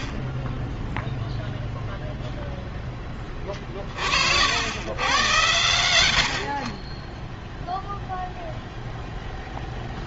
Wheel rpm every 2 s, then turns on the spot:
20, 0, 70, 50, 0.
none